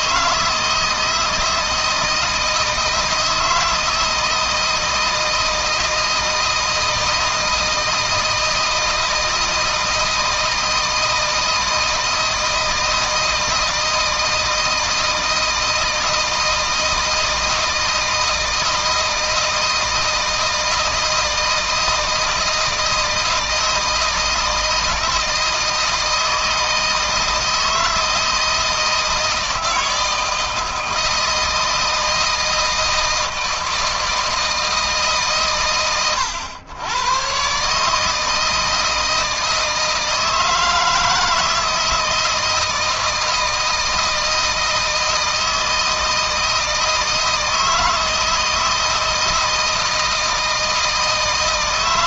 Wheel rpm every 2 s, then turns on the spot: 160, 160, 160, 160, 160, 160, 160, 160, 160, 160, 160, 160, 160, 160, 160, 160, 160, 140, 110, 160, 160, 160, 160, 160, 160, 160.
none